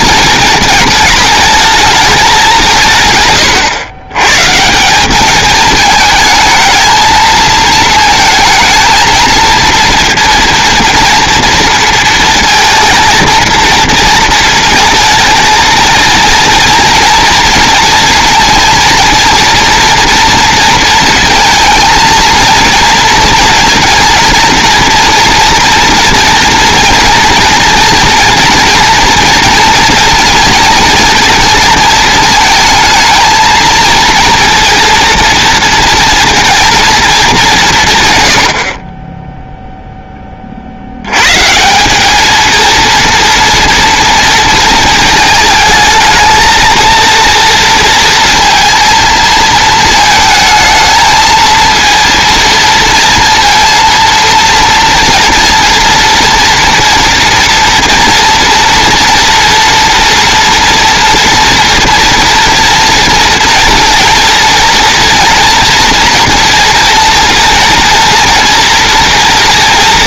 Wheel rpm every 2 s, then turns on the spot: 210, 160, 170, 220, 220, 230, 230, 230, 230, 230, 230, 230, 230, 230, 230, 230, 230, 230, 230, 40, 60, 230, 220, 230, 230, 220, 230, 230, 240, 230, 230, 230, 230, 230, 230.
none